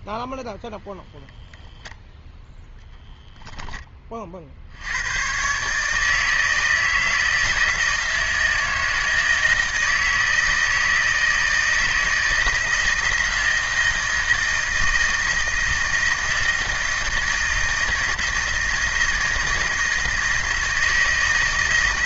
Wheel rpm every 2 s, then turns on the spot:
0, 10, 60, 160, 160, 160, 160, 160, 160, 160, 160.
none